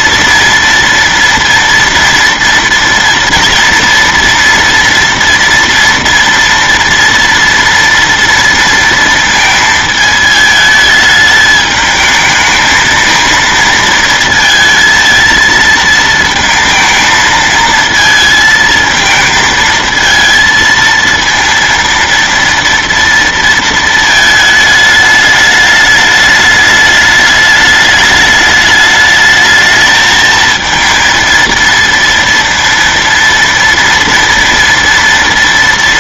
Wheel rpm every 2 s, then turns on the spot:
230, 230, 230, 240, 230, 220, 220, 220, 230, 220, 230, 230, 220, 210, 210, 220, 230, 230.
none